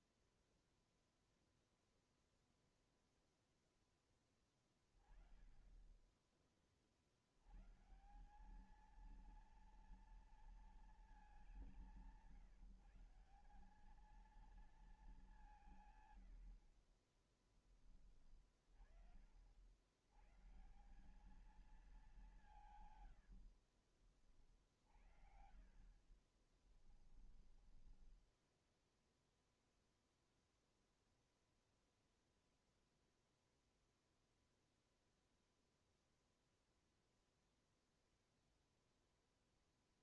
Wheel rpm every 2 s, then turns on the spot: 0, 0, 10, 30, 200, 230, 160, 220, 60, 30, 150, 160, 40, 20, 10, 0, 0, 0, 0, 0.
18-20 26-30